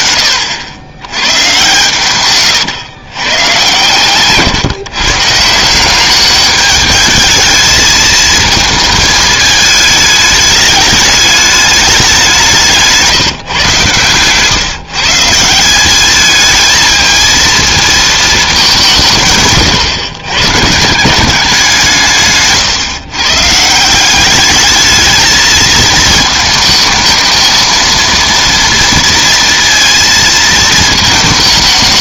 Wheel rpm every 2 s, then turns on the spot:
80, 120, 130, 210, 220, 210, 170, 140, 220, 200, 140, 140, 210, 220, 230, 220.
22-24